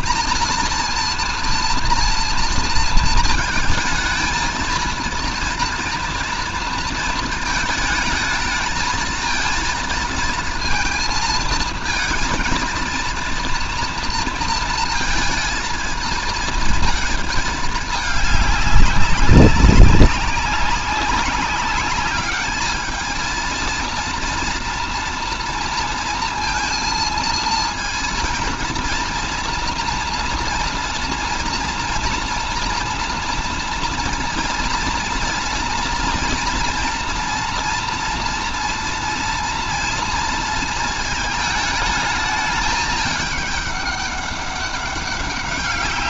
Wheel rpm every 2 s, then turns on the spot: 230, 230, 230, 230, 220, 230, 230, 230, 220, 200, 190, 220, 230, 230, 230, 230, 230, 230, 230, 230, 220, 210, 200.
none